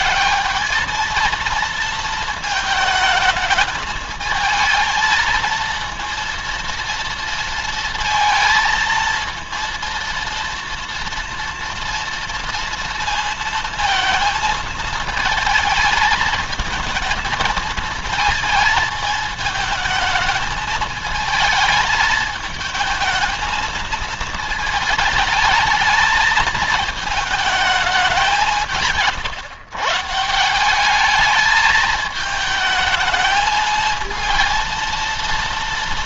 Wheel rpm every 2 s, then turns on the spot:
210, 220, 220, 230, 230, 230, 230, 220, 220, 220, 220, 220, 220, 220, 170, 180, 220, 230.
none